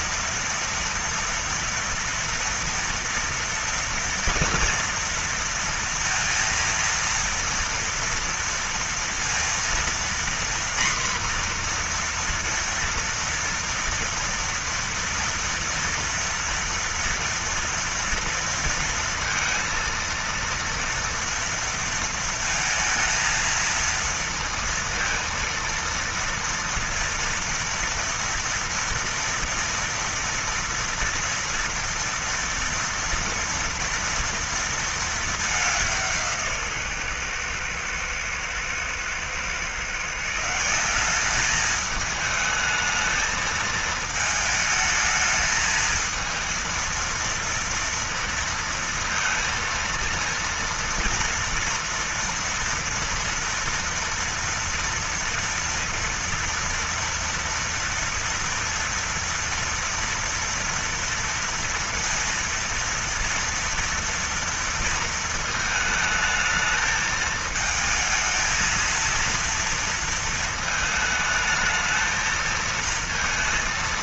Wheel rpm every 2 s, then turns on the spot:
230, 240, 230, 230, 230, 240, 240, 230, 230, 230, 230, 230, 230, 230, 230, 230, 230, 230, 160, 110, 160, 220, 220, 220, 230, 230, 230, 230, 230, 230, 230, 230, 230, 220, 220, 220, 230.
none